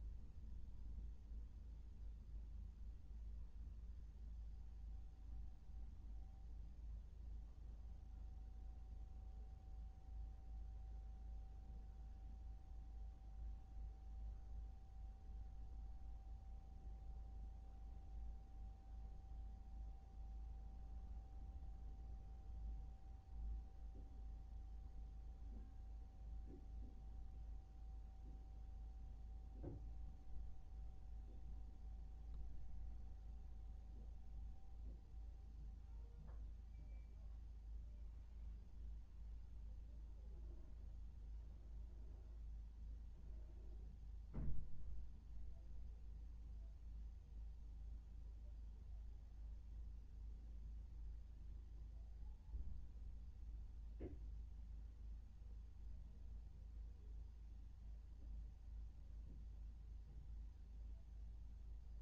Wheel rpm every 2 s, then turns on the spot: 0, 0, 0, 0, 0, 0, 0, 0, 0, 0, 0, 0, 0, 0, 0, 0, 0, 0, 0, 0, 0, 0, 0, 0, 0, 0, 0, 0, 0, 0, 0.
none